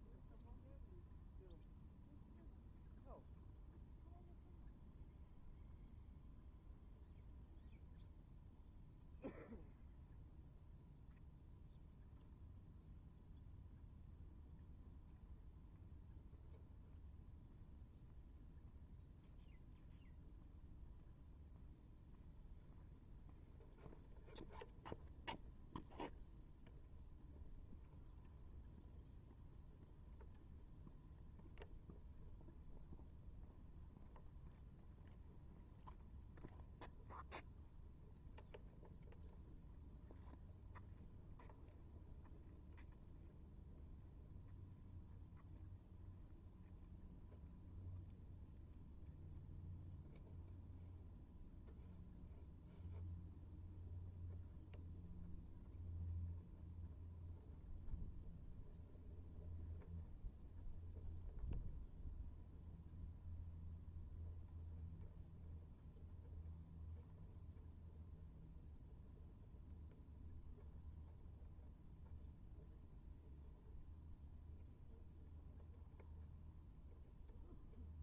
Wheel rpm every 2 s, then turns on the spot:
0, 0, 0, 0, 0, 0, 0, 0, 0, 0, 0, 0, 0, 0, 0, 0, 0, 0, 0, 0, 0, 0, 0, 0, 0, 0, 0, 0, 0, 0, 0, 0, 0, 0, 0, 0, 0, 0, 0.
none